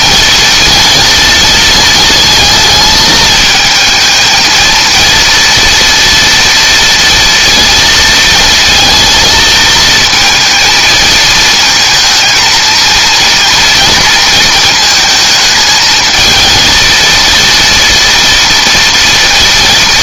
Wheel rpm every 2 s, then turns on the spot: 230, 220, 230, 230, 230, 220, 230, 220, 220, 230.
none